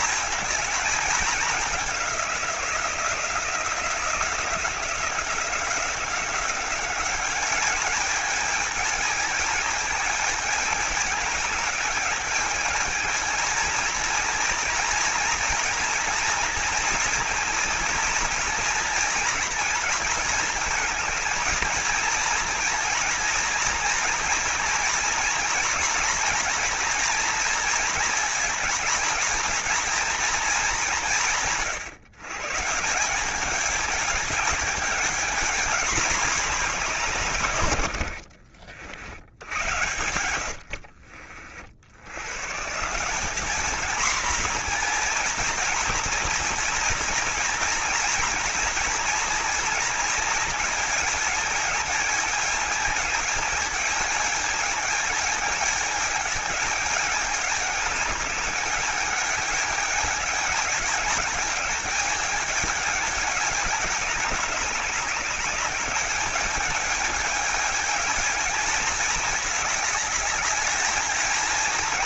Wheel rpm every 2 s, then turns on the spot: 220, 180, 180, 200, 210, 220, 220, 230, 230, 230, 220, 230, 230, 230, 240, 200, 170, 210, 190, 80, 70, 160, 230, 230, 230, 220, 210, 220, 210, 200, 210, 220, 200, 210, 220, 220.
40-42